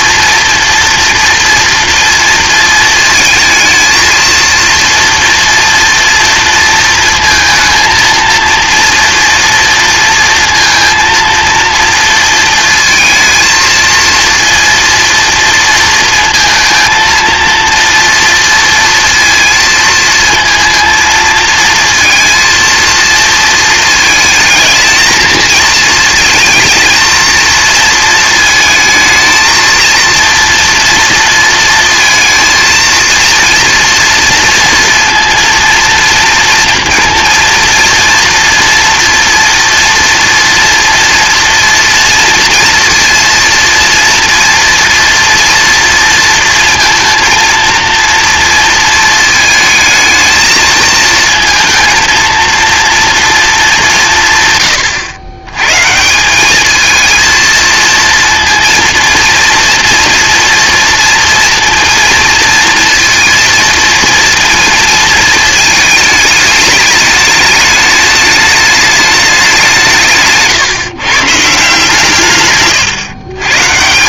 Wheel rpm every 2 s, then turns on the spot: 230, 220, 230, 230, 230, 230, 220, 230, 230, 230, 230, 230, 220, 230, 220, 230, 230, 230, 230, 230, 230, 230, 230, 230, 230, 220, 230, 130, 210, 230, 230, 230, 230, 210, 210, 150, 130.
72-74